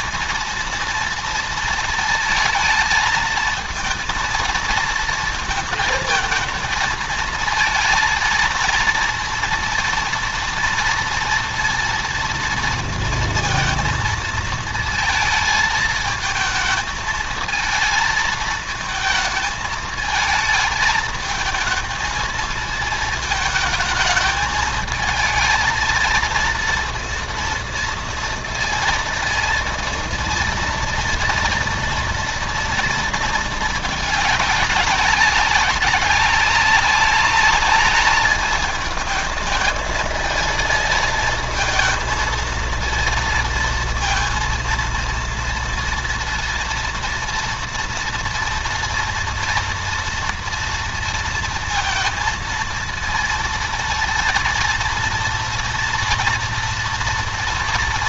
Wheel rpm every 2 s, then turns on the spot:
230, 220, 230, 230, 230, 230, 230, 220, 220, 220, 220, 220, 220, 230, 230, 230, 230, 200, 200, 210, 220, 230, 230, 230, 230, 230, 230, 230, 230.
none